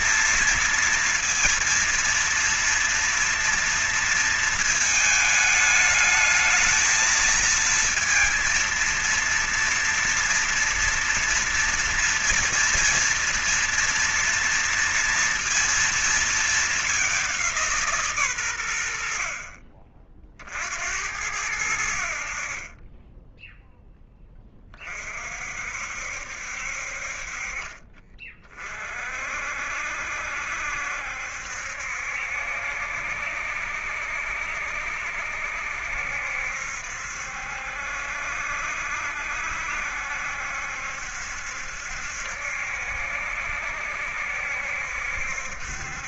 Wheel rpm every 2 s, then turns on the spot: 230, 230, 220, 220, 230, 230, 230, 240, 210, 110, 50, 50, 20, 60, 40, 70, 70, 70, 70, 70, 70, 70, 70.
none